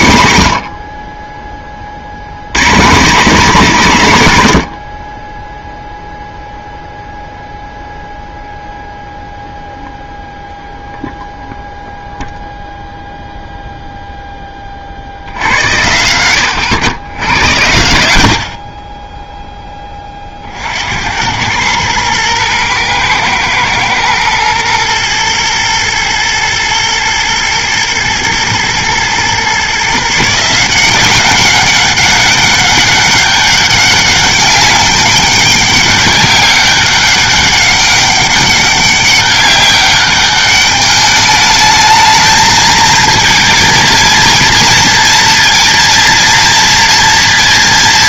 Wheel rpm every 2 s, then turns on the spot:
50, 150, 70, 0, 0, 0, 0, 50, 90, 30, 70, 120, 110, 120, 120, 170, 200, 200, 190, 200, 210, 220, 230, 230.
none